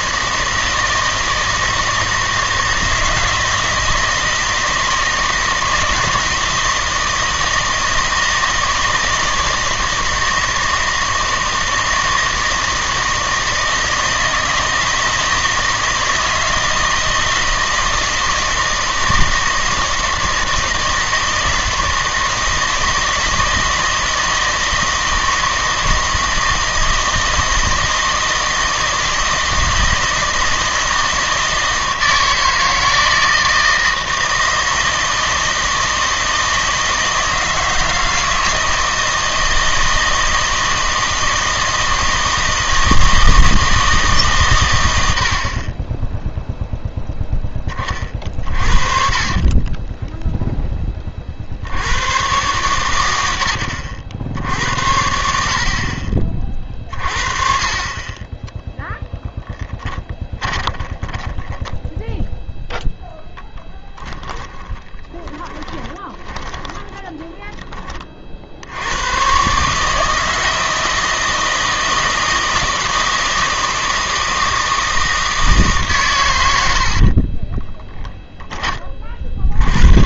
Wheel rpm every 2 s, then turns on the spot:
160, 160, 160, 160, 160, 160, 160, 160, 160, 160, 160, 160, 160, 160, 160, 160, 160, 160, 160, 160, 160, 160, 110, 0, 50, 10, 110, 70, 40, 0, 10, 10, 20, 10, 90, 160, 160, 160, 80, 20.
48-50 60-62 64-68 76-78